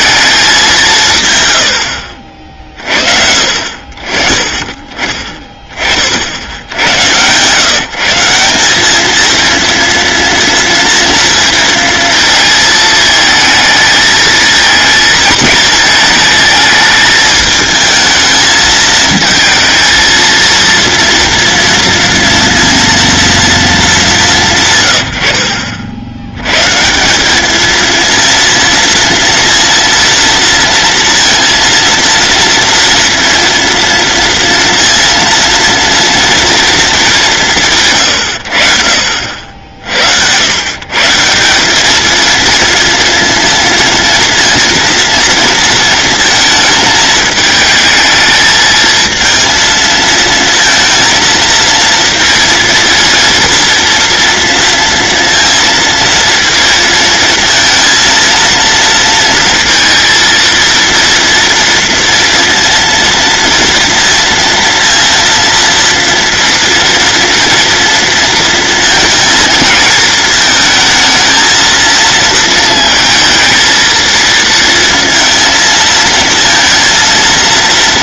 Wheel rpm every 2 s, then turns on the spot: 180, 40, 20, 90, 210, 230, 220, 220, 210, 220, 230, 230, 120, 160, 230, 230, 230, 230, 220, 70, 130, 230, 230, 220, 220, 230, 230, 230, 230, 230, 230, 230, 230, 240, 230, 220, 230, 230, 230.
none